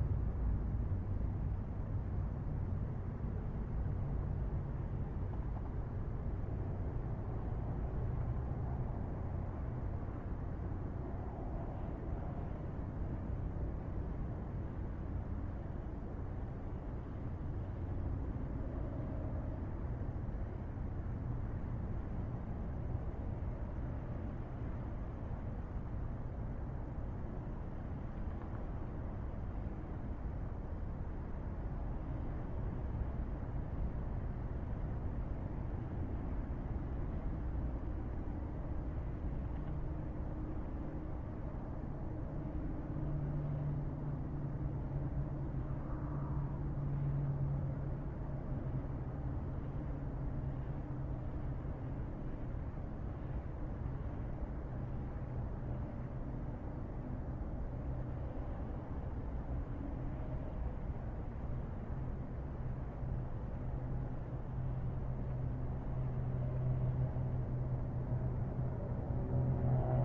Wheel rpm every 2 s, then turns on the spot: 0, 0, 0, 0, 0, 0, 0, 0, 0, 0, 0, 0, 0, 0, 0, 0, 0, 0, 0, 0, 0, 0, 0, 0, 0, 0, 0, 0, 0, 0, 0, 0, 0, 0, 0.
none